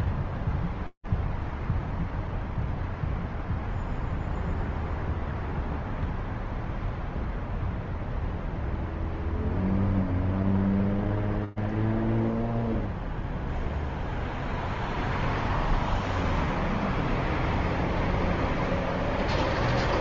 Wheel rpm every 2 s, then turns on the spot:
0, 0, 0, 0, 0, 0, 0, 0, 0, 0.
none